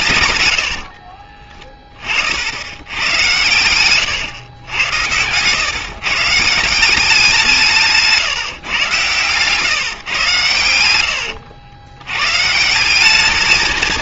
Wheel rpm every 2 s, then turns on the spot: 30, 90, 100, 190, 120, 90, 200.
0-2 8-12